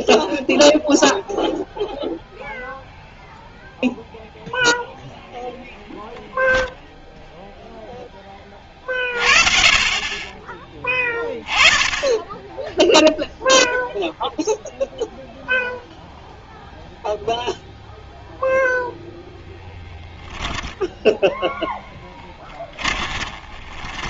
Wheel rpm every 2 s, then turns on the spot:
0, 0, 0, 0, 30, 10, 10, 0, 0, 0, 10, 10.
none